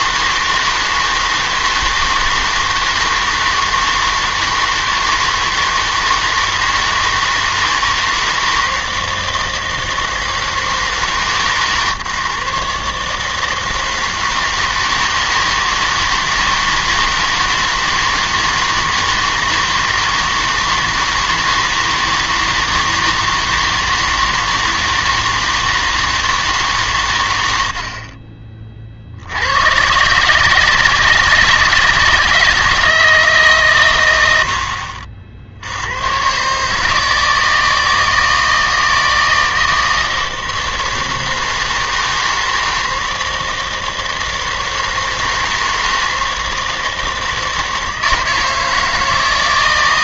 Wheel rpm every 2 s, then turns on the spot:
160, 160, 160, 160, 160, 160, 150, 160, 160, 160, 160, 160, 160, 150, 40, 150, 160, 70, 140, 160, 160, 160, 160, 160, 160.
none